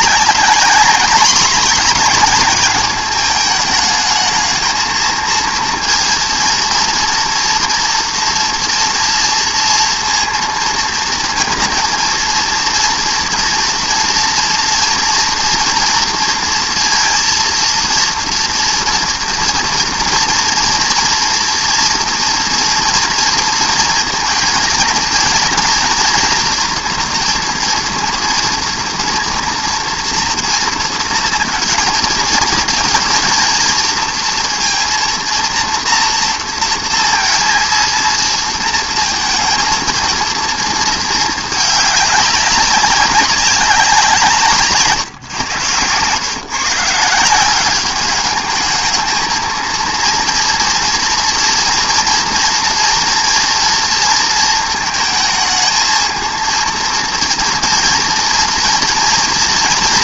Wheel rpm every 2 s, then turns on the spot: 200, 200, 220, 230, 230, 230, 230, 230, 230, 230, 230, 230, 230, 240, 230, 230, 230, 230, 230, 230, 230, 200, 150, 140, 210, 230, 230, 230, 230, 240.
none